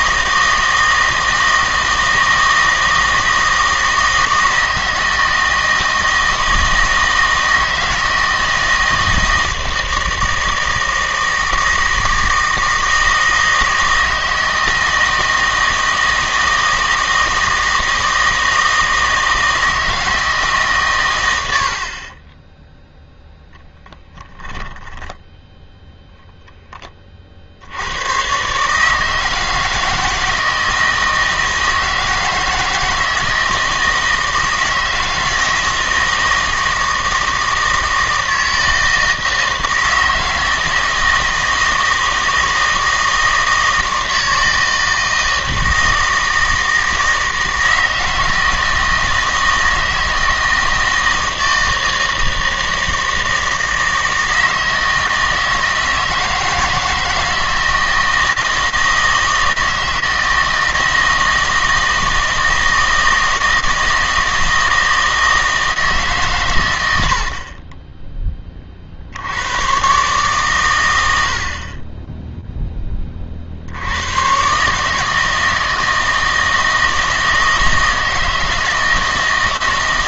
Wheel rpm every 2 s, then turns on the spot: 160, 160, 160, 160, 160, 160, 160, 160, 160, 160, 140, 0, 10, 10, 150, 160, 160, 160, 160, 160, 160, 160, 160, 160, 160, 160, 160, 160, 160, 160, 160, 160, 160, 110, 30, 110, 10, 140, 160, 160.
none